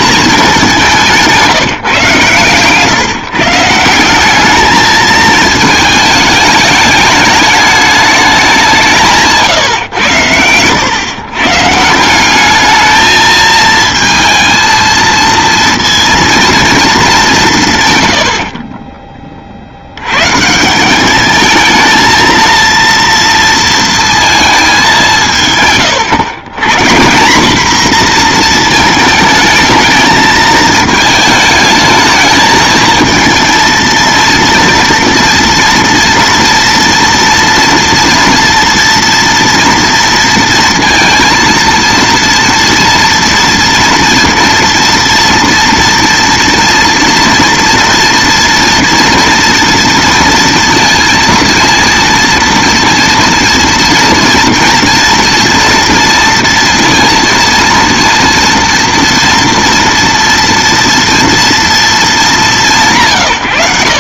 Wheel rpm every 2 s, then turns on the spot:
200, 130, 200, 210, 190, 100, 200, 230, 230, 30, 170, 230, 220, 140, 230, 220, 220, 230, 230, 230, 230, 230, 230, 230, 230, 230, 230, 230, 230, 230, 230, 170.
2-4